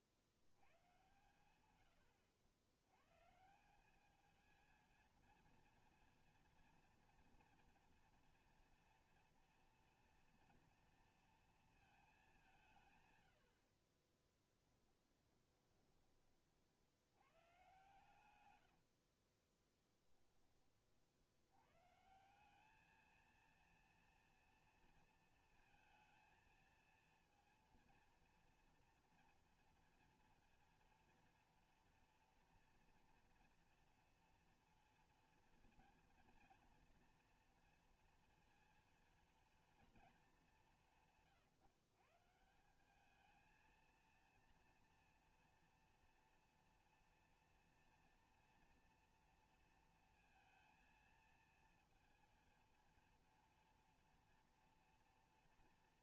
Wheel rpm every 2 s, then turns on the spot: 80, 110, 220, 240, 230, 230, 190, 20, 50, 110, 30, 190, 230, 230, 230, 230, 230, 230, 230, 230, 200, 160, 230, 230, 230, 230, 230, 240.
14-16 18-20